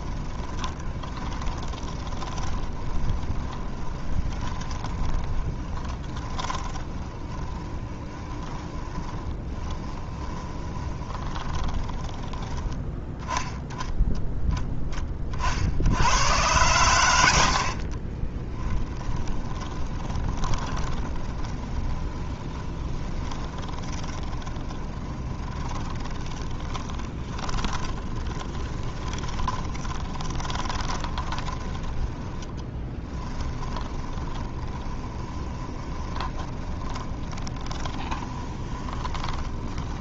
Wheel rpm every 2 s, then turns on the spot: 20, 20, 20, 20, 20, 20, 10, 10, 100, 10, 10, 20, 20, 20, 20, 20, 20, 20, 20, 20.
0-12 18-40